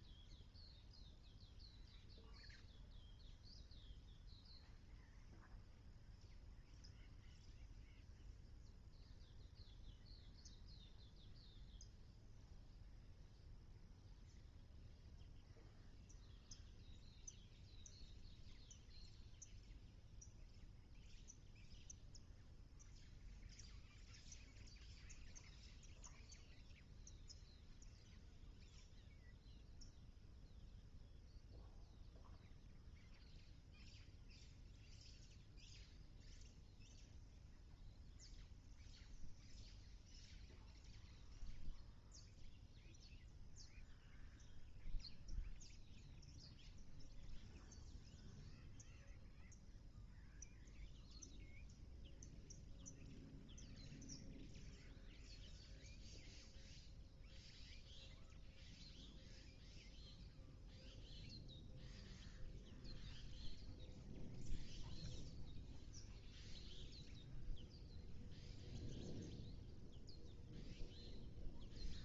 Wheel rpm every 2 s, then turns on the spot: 0, 0, 0, 0, 0, 0, 0, 0, 0, 0, 0, 0, 0, 0, 0, 0, 0, 0, 0, 0, 0, 0, 0, 0, 0, 0, 0, 0, 0, 0, 0, 0, 0, 0, 0, 0.
none